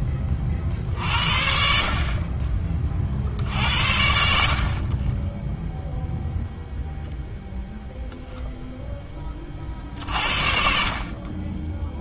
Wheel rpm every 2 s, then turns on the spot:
60, 30, 40, 0, 0, 50.
none